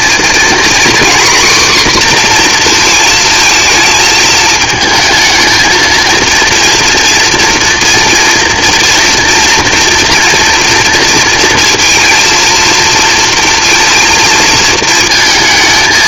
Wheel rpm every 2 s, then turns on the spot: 250, 240, 220, 230, 230, 240, 230, 230.
none